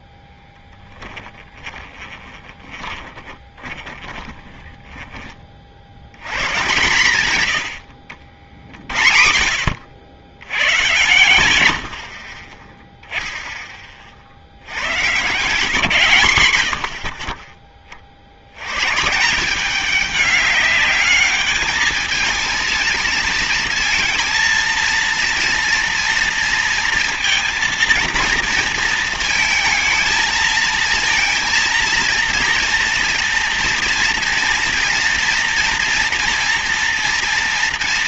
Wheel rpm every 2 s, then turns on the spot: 10, 20, 20, 120, 80, 120, 20, 70, 100, 100, 210, 230, 230, 230, 230, 230, 230, 230, 230.
0-6